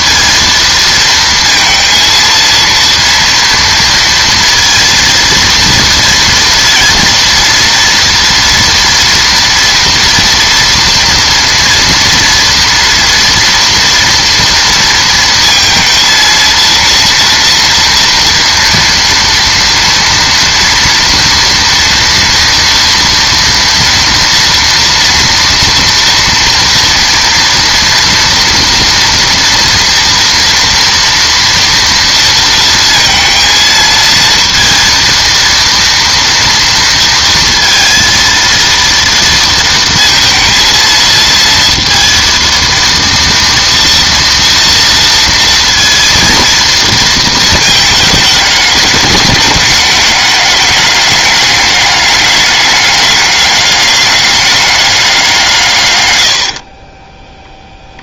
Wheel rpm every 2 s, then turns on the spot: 230, 230, 230, 230, 230, 230, 230, 230, 230, 230, 230, 230, 230, 230, 230, 230, 230, 230, 230, 230, 220, 230, 230, 230, 210, 200, 200, 200, 30.
56-58